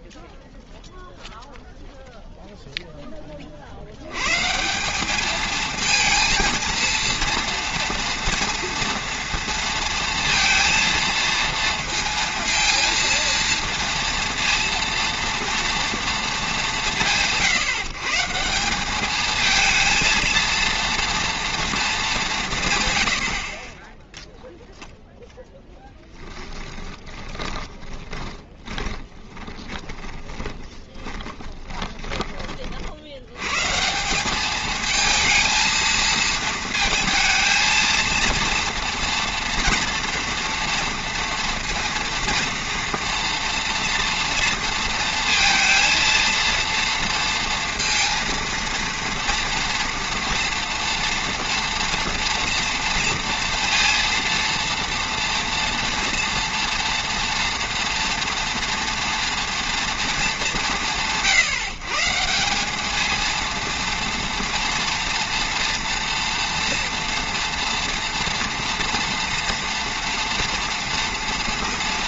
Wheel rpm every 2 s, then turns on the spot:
0, 0, 160, 230, 230, 230, 230, 230, 200, 180, 230, 150, 0, 10, 20, 20, 50, 220, 230, 230, 230, 230, 230, 230, 230, 230, 230, 230, 230, 230, 190, 200, 230, 240, 230, 230.
26-32